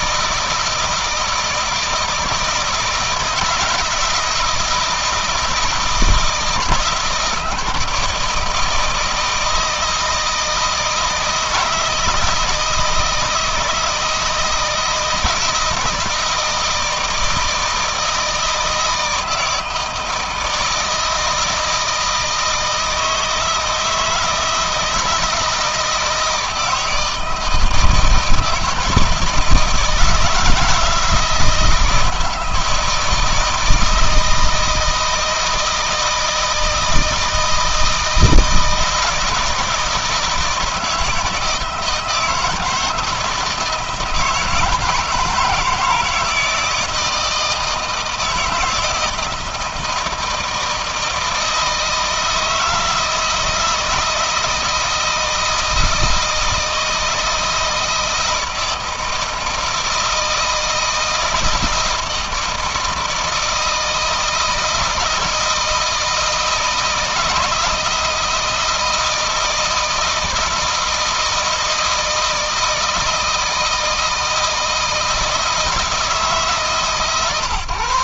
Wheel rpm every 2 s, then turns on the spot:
160, 160, 160, 160, 160, 160, 160, 160, 160, 160, 160, 160, 160, 160, 160, 170, 160, 160, 160, 160, 160, 160, 150, 160, 160, 160, 160, 160, 160, 160, 170, 160, 160, 160, 160, 160, 160, 160, 140.
none